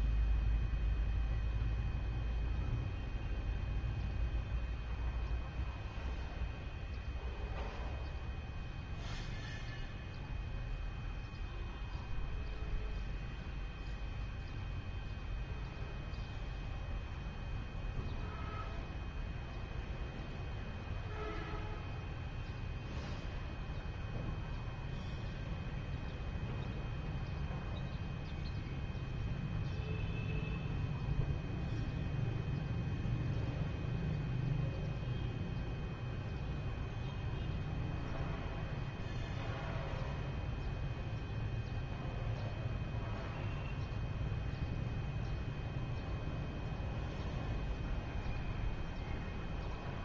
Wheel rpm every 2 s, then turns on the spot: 0, 0, 0, 0, 0, 0, 0, 0, 0, 0, 0, 0, 0, 0, 0, 0, 0, 0, 0, 0, 0, 0, 0, 0, 0.
none